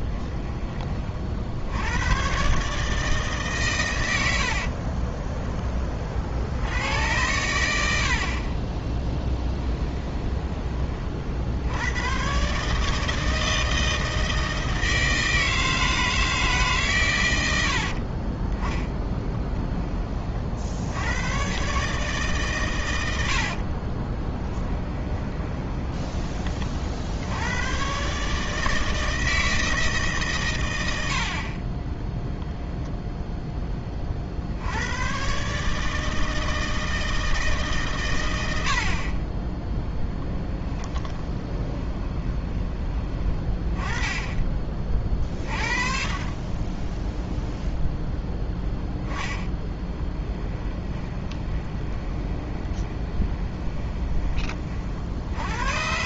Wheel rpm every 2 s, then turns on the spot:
30, 150, 30, 90, 20, 30, 160, 160, 120, 10, 90, 100, 10, 50, 160, 80, 0, 100, 160, 60, 10, 20, 30, 10, 10, 20, 20, 50.
4-6 8-10 24-26 40-42 48-54